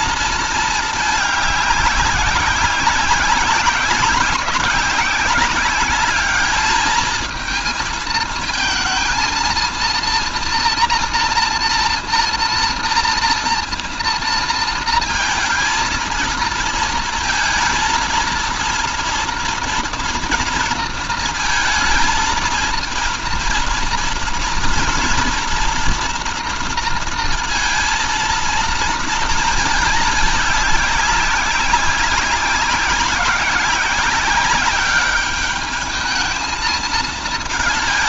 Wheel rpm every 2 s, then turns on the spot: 220, 190, 190, 210, 230, 230, 230, 220, 230, 230, 230, 230, 230, 230, 230, 200, 190, 200, 220.
none